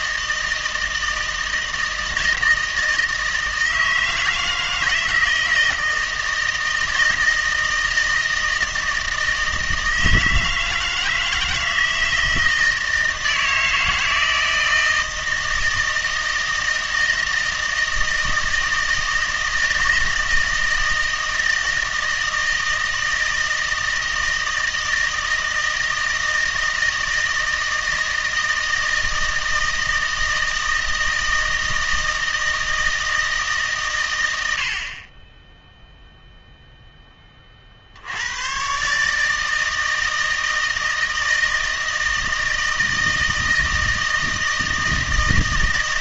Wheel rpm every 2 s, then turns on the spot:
160, 160, 160, 160, 160, 160, 160, 160, 160, 160, 160, 160, 160, 160, 160, 160, 160, 60, 0, 120, 160, 160, 160.
none